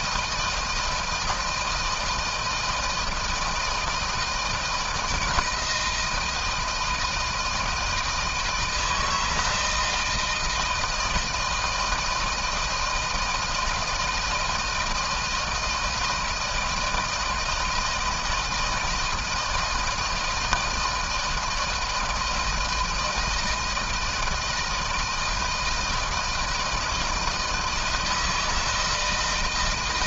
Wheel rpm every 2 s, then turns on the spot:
160, 160, 170, 160, 160, 160, 160, 160, 160, 160, 160, 160, 160, 160, 160.
none